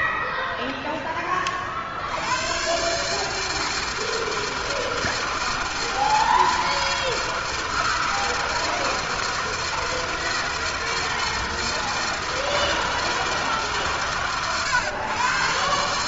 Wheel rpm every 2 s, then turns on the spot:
80, 160, 160, 160, 160, 160, 140, 110.
none